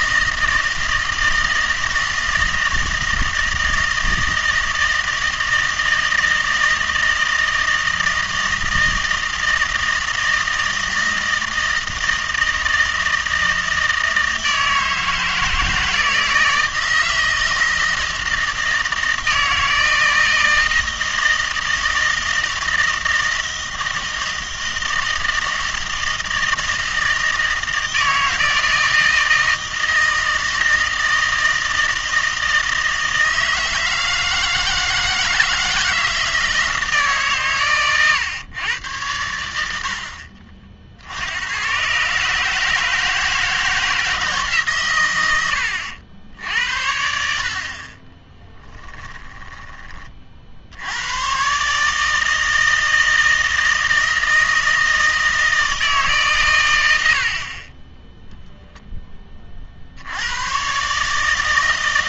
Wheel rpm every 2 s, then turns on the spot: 160, 160, 160, 160, 160, 160, 160, 160, 160, 160, 160, 160, 160, 160, 160, 160, 160, 160, 160, 110, 60, 150, 130, 80, 20, 70, 160, 160, 110, 0, 130.
48-50